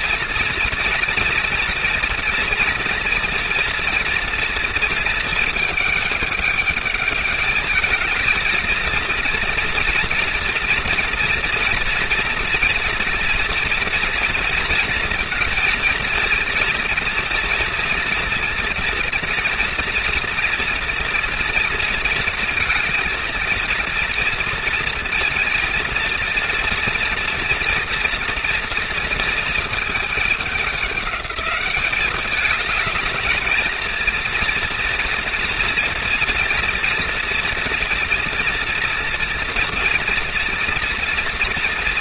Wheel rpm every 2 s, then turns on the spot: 230, 230, 220, 220, 240, 230, 230, 230, 230, 230, 230, 230, 230, 230, 220, 200, 230, 240, 230, 240, 230.
none